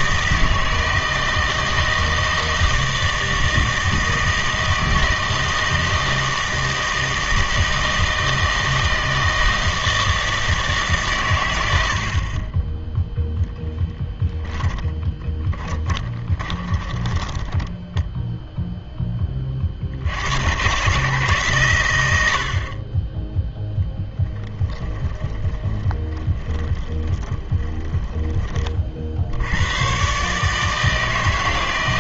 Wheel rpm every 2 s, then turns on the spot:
160, 160, 160, 160, 160, 160, 10, 10, 20, 0, 120, 40, 10, 20, 30, 150.
14-18 24-28